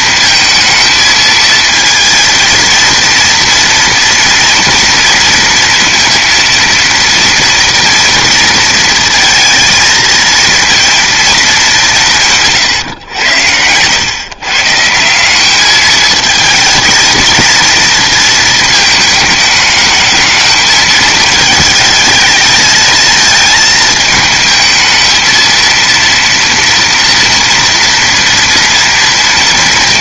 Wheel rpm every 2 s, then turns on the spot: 220, 230, 230, 230, 230, 230, 140, 150, 220, 220, 220, 220, 220, 230, 230.
none